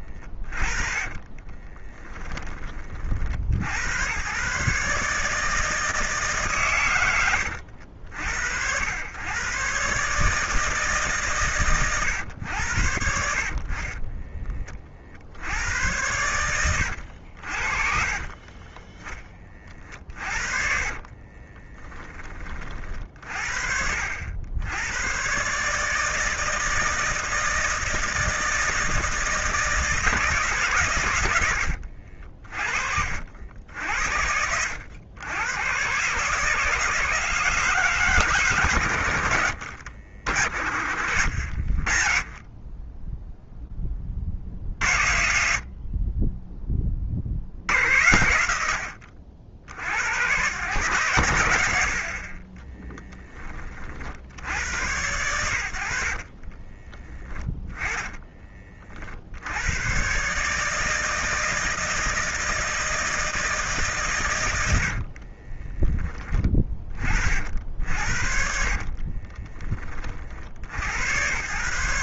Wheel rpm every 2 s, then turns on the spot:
30, 40, 150, 120, 100, 150, 80, 50, 90, 40, 40, 40, 100, 160, 160, 120, 50, 100, 160, 100, 60, 20, 50, 30, 80, 100, 10, 100, 20, 50, 160, 160, 70, 50, 40, 90.
0-2 20-22 40-44 56-58 64-66 68-70